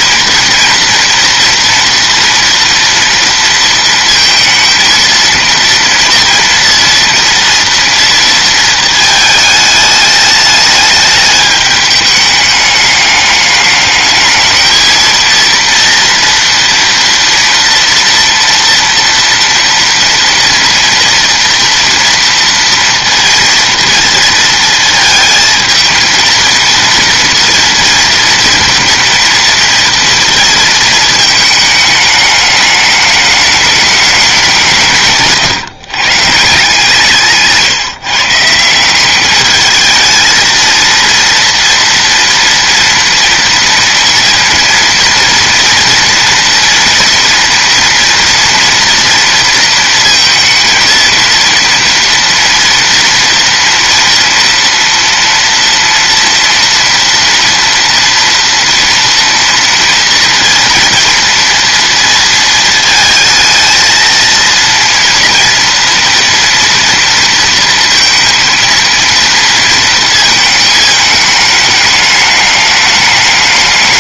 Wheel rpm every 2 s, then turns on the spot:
230, 230, 230, 230, 220, 210, 210, 220, 230, 230, 230, 230, 230, 230, 230, 230, 210, 190, 150, 170, 230, 240, 230, 240, 230, 230, 230, 240, 230, 230, 230, 230, 230, 230, 230, 220, 210.
none